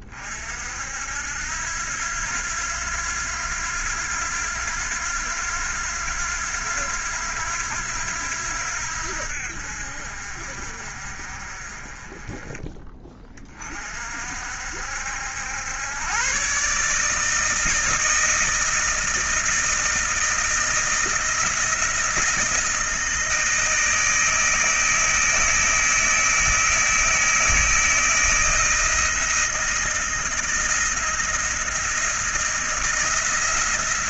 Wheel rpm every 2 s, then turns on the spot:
40, 90, 90, 90, 80, 60, 30, 50, 110, 160, 160, 170, 160, 160, 160, 160, 160.
none